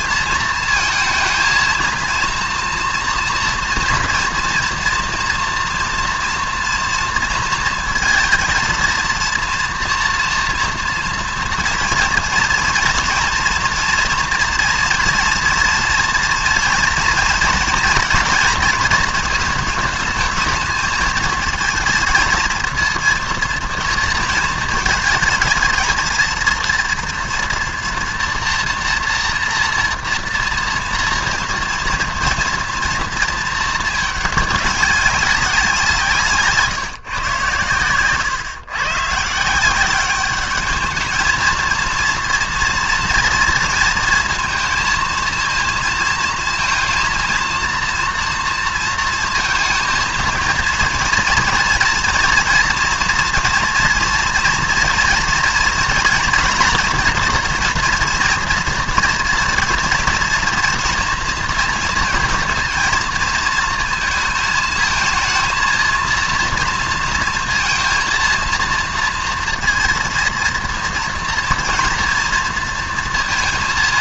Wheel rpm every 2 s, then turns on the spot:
220, 230, 240, 230, 230, 230, 240, 240, 230, 220, 220, 230, 220, 230, 230, 230, 230, 210, 160, 130, 210, 230, 230, 230, 230, 230, 230, 230, 230, 240, 240, 220, 220, 230, 230, 230, 230.
none